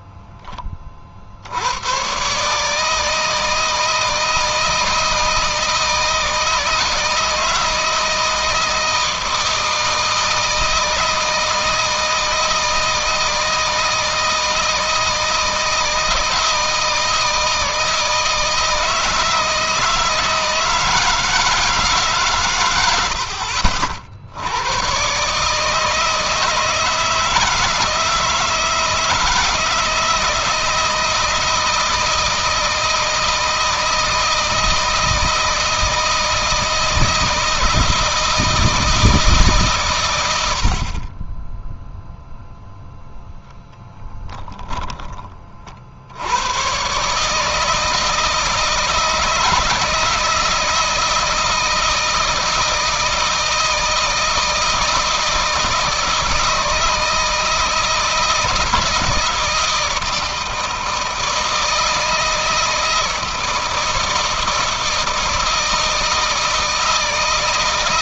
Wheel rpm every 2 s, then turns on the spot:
30, 150, 160, 160, 160, 160, 160, 160, 160, 160, 160, 100, 110, 160, 160, 160, 160, 160, 160, 160, 50, 0, 10, 120, 160, 160, 160, 160, 160, 160, 160, 160, 160, 160.
none